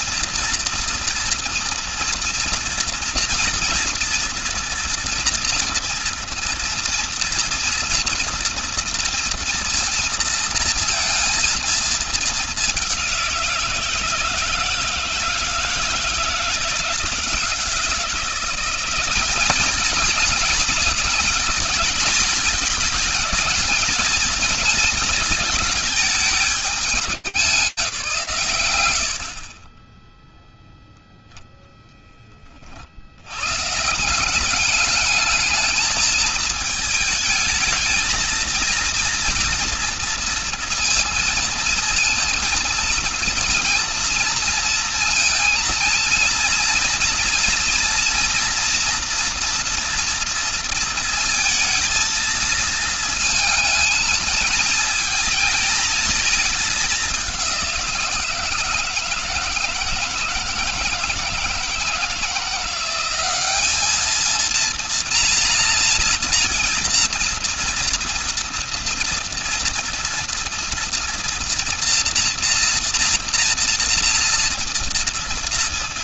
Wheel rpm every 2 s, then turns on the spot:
240, 230, 230, 230, 230, 230, 200, 160, 160, 190, 230, 230, 220, 210, 90, 0, 50, 200, 220, 230, 230, 230, 230, 230, 240, 230, 220, 220, 210, 160, 160, 190, 230, 230, 240, 240, 230, 230.
none